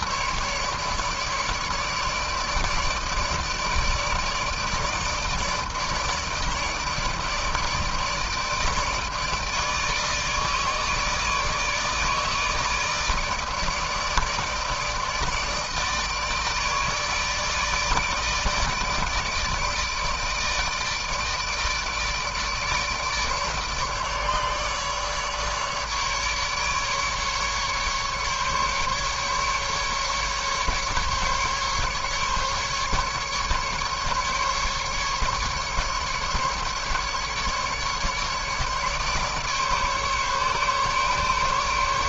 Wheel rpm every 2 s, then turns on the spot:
150, 150, 160, 160, 150, 150, 160, 160, 150, 150, 160, 150, 150, 150, 140, 150, 140, 150, 140, 150, 150.
none